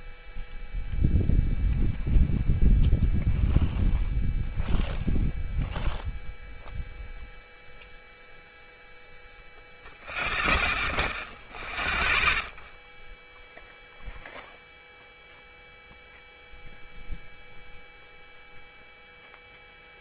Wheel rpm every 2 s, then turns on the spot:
0, 0, 0, 0, 0, 0, 0, 0, 0, 0.
none